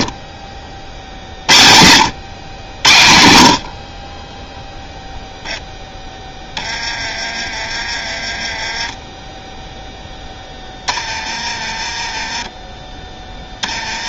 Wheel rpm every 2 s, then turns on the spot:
60, 100, 0, 20, 10, 10, 10.
none